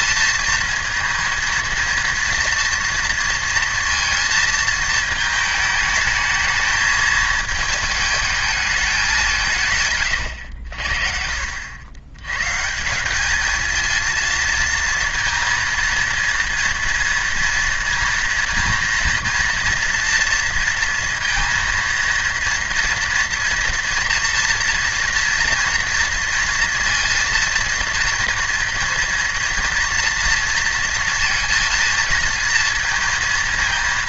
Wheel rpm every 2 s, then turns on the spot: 230, 230, 220, 220, 220, 80, 120, 230, 230, 230, 230, 230, 230, 230, 230, 230, 230.
none